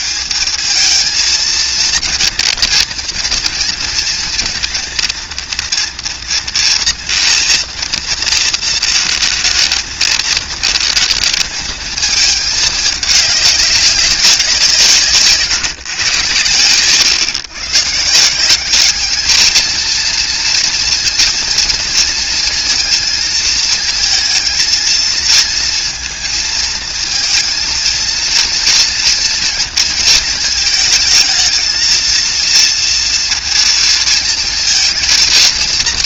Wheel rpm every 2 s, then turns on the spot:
220, 230, 230, 230, 230, 220, 210, 170, 110, 200, 230, 230, 230, 230, 230, 220, 230, 230.
none